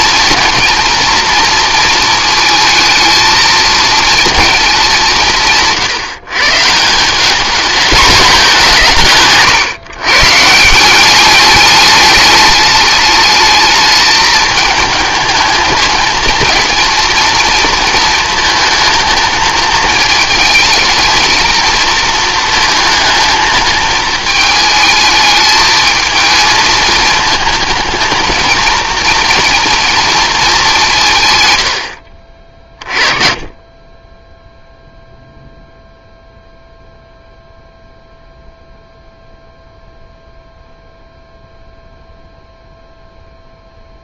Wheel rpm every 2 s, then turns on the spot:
240, 220, 210, 160, 180, 160, 210, 220, 220, 220, 220, 230, 220, 220, 230, 200, 40, 0, 0, 0, 0, 0.
none